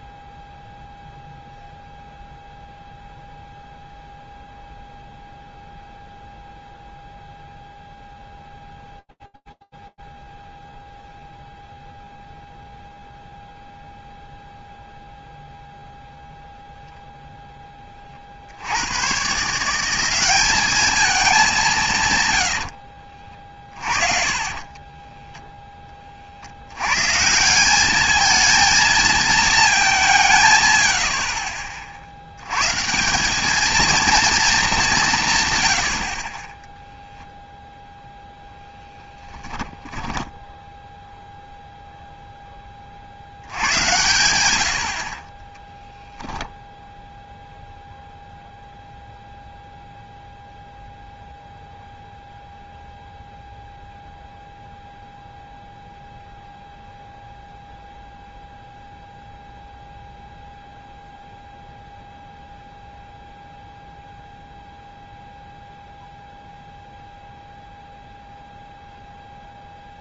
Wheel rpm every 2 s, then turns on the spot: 0, 0, 0, 0, 0, 0, 0, 0, 0, 90, 210, 60, 20, 130, 230, 80, 170, 170, 0, 10, 0, 50, 50, 0, 0, 0, 0, 0, 0, 0, 0, 0, 0, 0, 0.
22-26 38-40